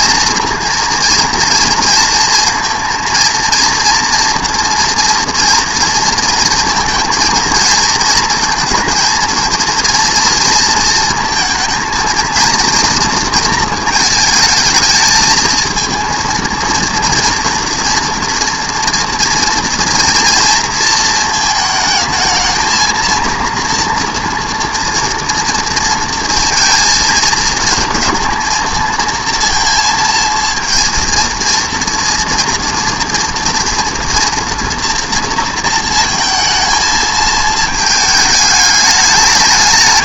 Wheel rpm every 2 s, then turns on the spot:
230, 230, 230, 230, 230, 230, 230, 220, 230, 230, 230, 220, 230, 230, 230, 230, 230, 240, 220, 210.
none